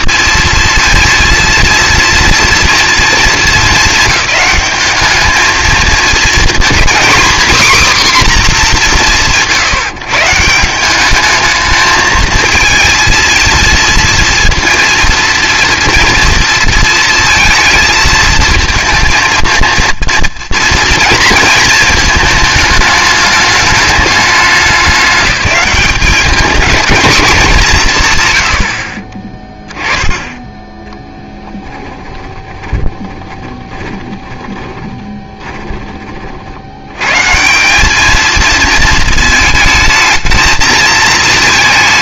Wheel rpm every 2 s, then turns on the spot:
230, 230, 210, 240, 220, 170, 230, 230, 230, 220, 230, 220, 200, 220, 60, 10, 20, 20, 80, 230, 220.
32-36